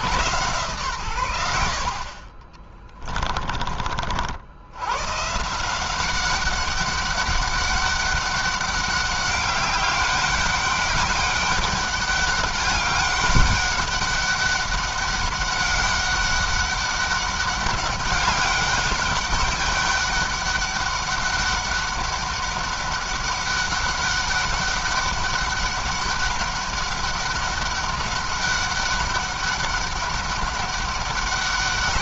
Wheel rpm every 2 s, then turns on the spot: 120, 20, 100, 200, 200, 200, 200, 200, 200, 200, 200, 200, 200, 200, 200, 200.
2-4